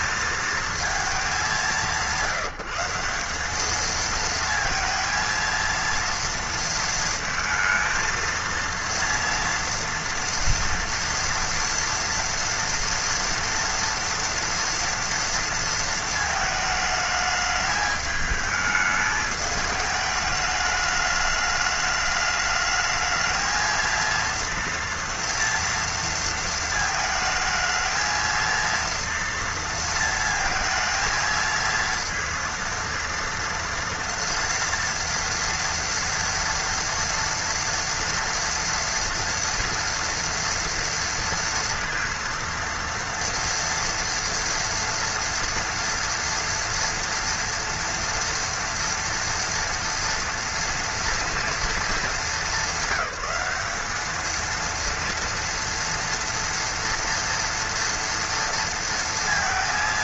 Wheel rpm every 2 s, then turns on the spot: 220, 180, 230, 230, 230, 230, 230, 230, 220, 210, 210, 210, 230, 220, 230, 220, 230, 230, 230, 230, 230, 230, 240, 230, 230, 230, 200, 230, 230, 230.
none